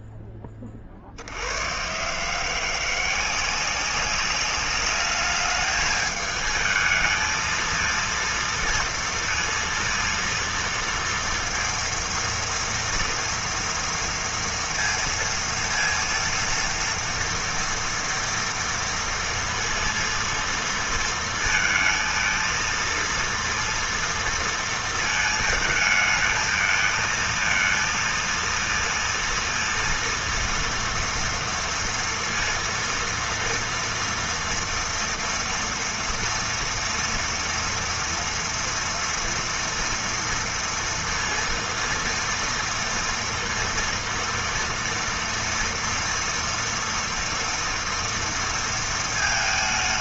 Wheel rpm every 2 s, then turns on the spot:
20, 160, 200, 220, 230, 230, 230, 230, 230, 230, 230, 230, 230, 220, 230, 230, 230, 230, 230, 240, 230, 230, 230, 230, 230.
none